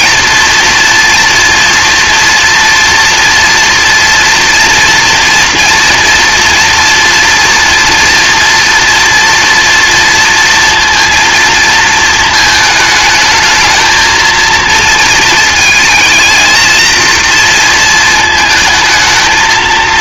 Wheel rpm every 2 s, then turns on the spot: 240, 240, 230, 230, 230, 230, 220, 230, 230, 220.
none